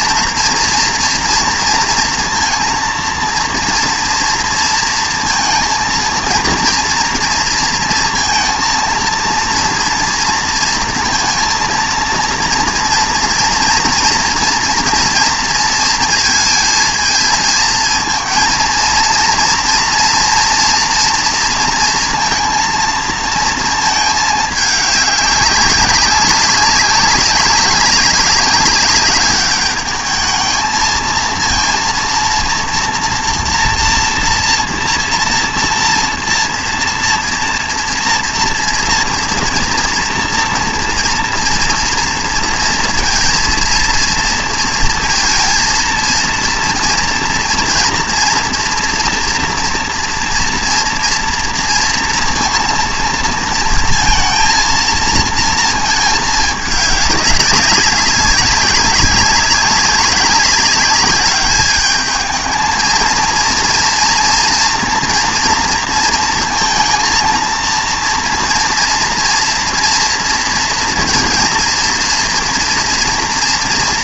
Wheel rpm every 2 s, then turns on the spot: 230, 230, 230, 230, 230, 230, 240, 230, 230, 230, 240, 230, 210, 200, 200, 220, 230, 230, 230, 230, 230, 230, 230, 230, 230, 230, 230, 230, 210, 200, 200, 220, 230, 230, 230, 230, 230.
none